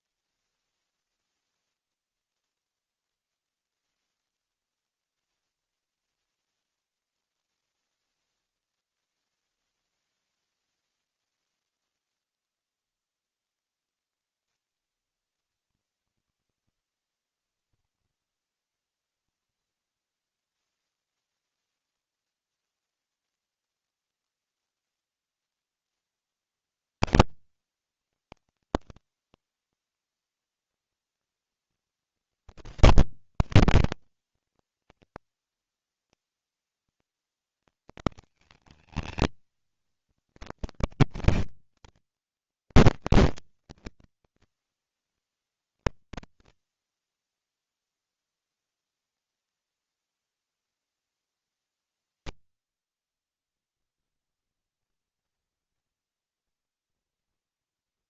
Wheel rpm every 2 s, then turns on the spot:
0, 0, 0, 0, 0, 0, 0, 10, 80, 70, 20, 0, 0, 120, 150, 120, 90, 120, 120, 160, 150, 190, 190, 190, 120, 100, 60, 10, 0.
18-22 52-56